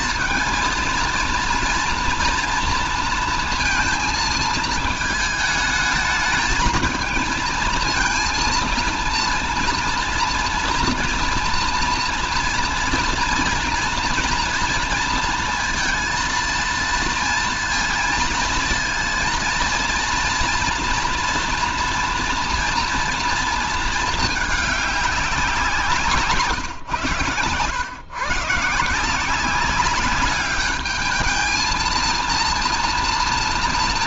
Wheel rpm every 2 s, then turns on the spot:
230, 230, 220, 220, 230, 230, 230, 230, 230, 230, 230, 230, 200, 130, 160, 210, 230.
none